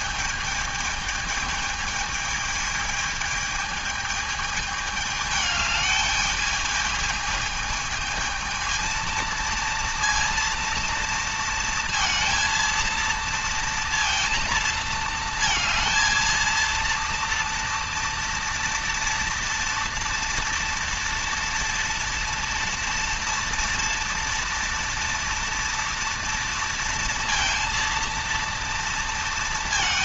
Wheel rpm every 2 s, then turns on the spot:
220, 220, 220, 210, 220, 230, 230, 230, 230, 230, 230, 230, 230, 230, 230.
none